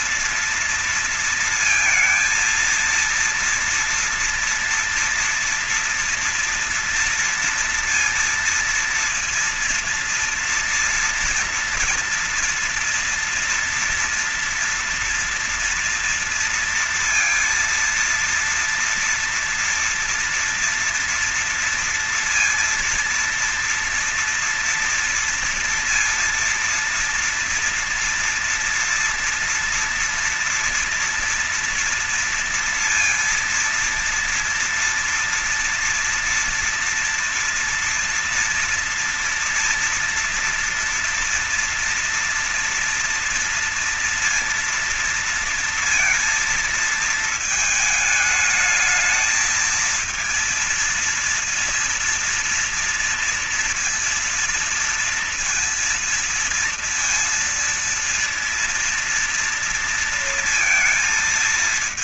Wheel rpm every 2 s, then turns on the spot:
230, 230, 230, 230, 230, 240, 230, 230, 230, 230, 230, 240, 230, 230, 230, 230, 230, 230, 230, 240, 230, 230, 230, 220, 220, 230, 230, 230, 230, 230, 230.
none